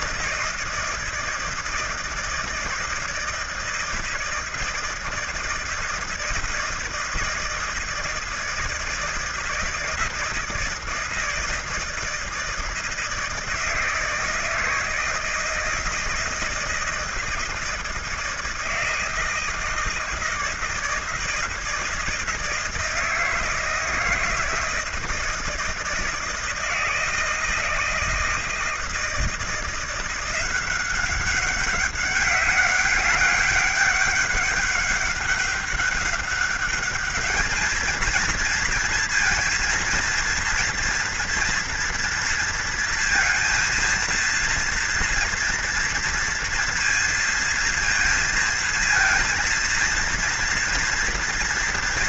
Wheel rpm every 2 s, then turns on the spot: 160, 160, 160, 160, 160, 160, 160, 160, 160, 160, 160, 170, 160, 160, 160, 190, 200, 200, 210, 230, 230, 230, 230, 230, 230, 230.
none